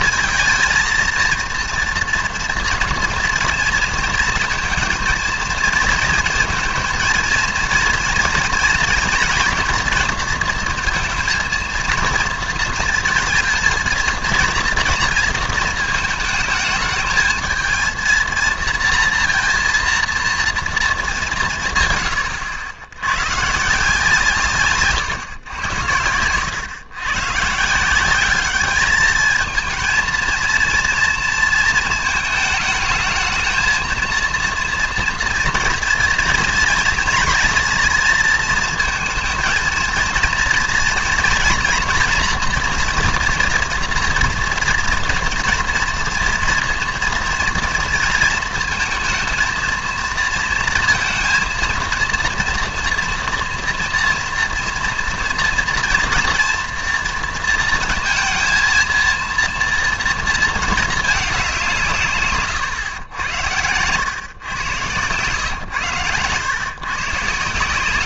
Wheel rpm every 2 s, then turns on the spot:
230, 230, 230, 230, 230, 230, 230, 230, 220, 230, 230, 80, 140, 100, 210, 230, 220, 230, 230, 230, 230, 230, 230, 230, 230, 230, 240, 230, 240, 230, 220, 120, 120, 110.
none